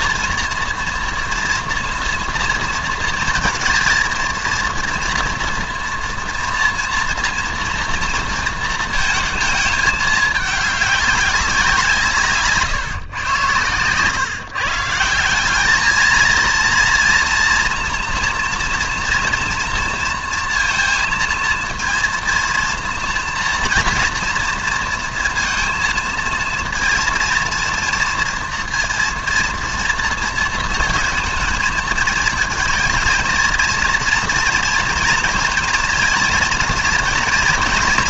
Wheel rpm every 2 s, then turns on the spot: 240, 230, 230, 240, 230, 210, 150, 140, 230, 230, 230, 230, 230, 230, 240, 230, 230, 230, 230.
12-14